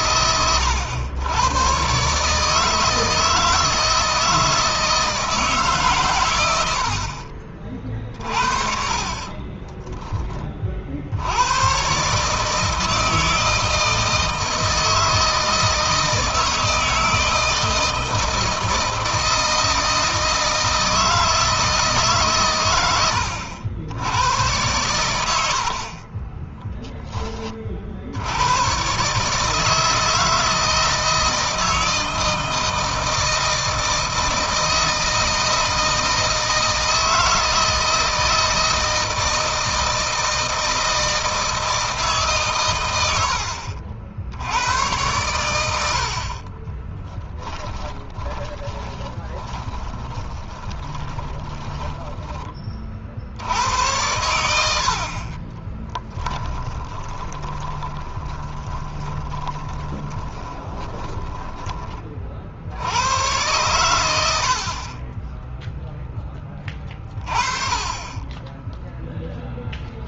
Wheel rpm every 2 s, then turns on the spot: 100, 160, 160, 90, 40, 50, 160, 160, 160, 160, 160, 100, 100, 10, 120, 160, 160, 160, 160, 160, 160, 110, 100, 30, 20, 20, 40, 70, 20, 20, 20, 80, 30, 20, 0.
8-10 46-52 56-62